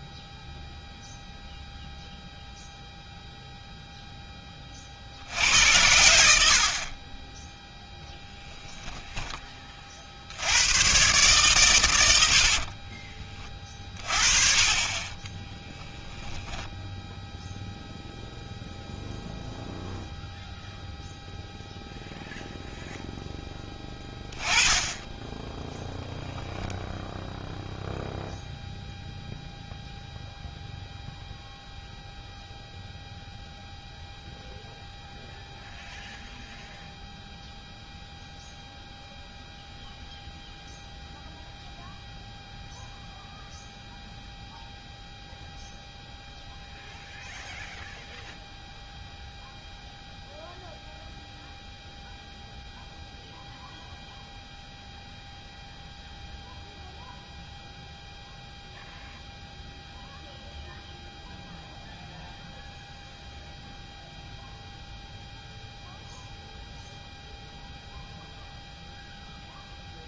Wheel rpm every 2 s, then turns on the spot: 0, 0, 10, 70, 10, 80, 60, 30, 10, 0, 0, 0, 10, 0, 0, 0, 0, 0, 0, 0, 0, 0, 0, 0, 0, 0, 0, 0, 0, 0, 0, 0, 0, 0, 0.
8-10 12-14 16-18